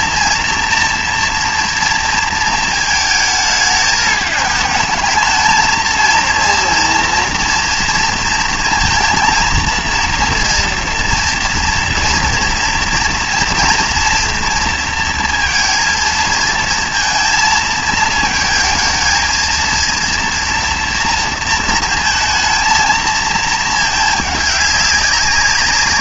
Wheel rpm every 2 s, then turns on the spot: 230, 220, 220, 230, 230, 230, 230, 230, 230, 220, 230, 230, 200.
none